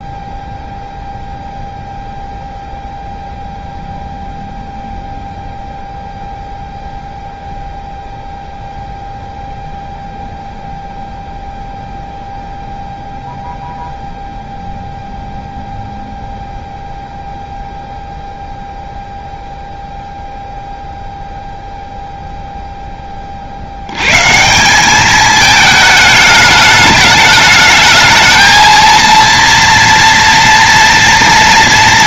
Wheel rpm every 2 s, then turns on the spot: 0, 0, 0, 0, 0, 0, 0, 0, 0, 0, 0, 0, 170, 210, 230, 230.
none